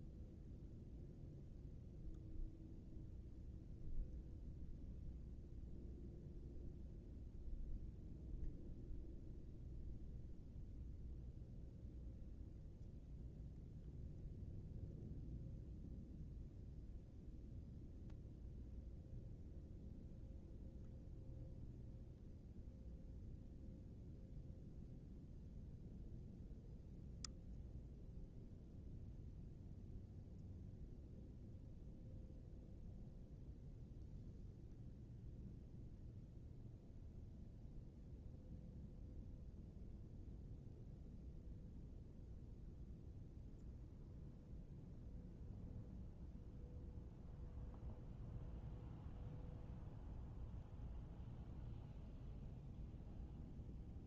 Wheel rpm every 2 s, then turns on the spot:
0, 0, 0, 0, 0, 0, 0, 0, 0, 0, 0, 0, 0, 0, 0, 0, 0, 0, 0, 0, 0, 0, 0, 0, 0, 0, 0.
none